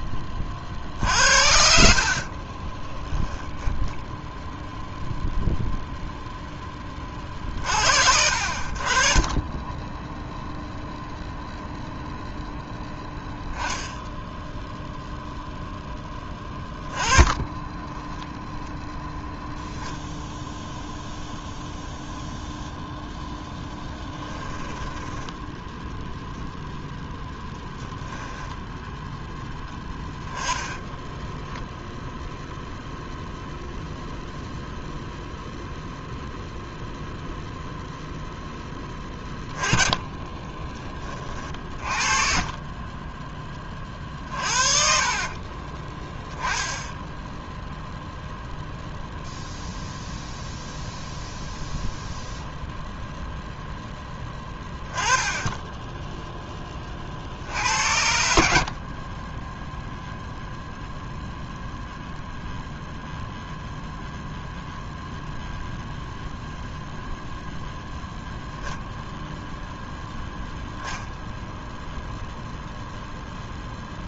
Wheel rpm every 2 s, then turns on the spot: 30, 20, 0, 10, 50, 0, 0, 0, 10, 0, 0, 10, 10, 0, 10, 20, 0, 0, 0, 10, 20, 30, 50, 0, 0, 0, 0, 10, 20, 60, 0, 0, 0, 0, 0, 0, 0.
2-4 16-18 24-26 44-46 54-56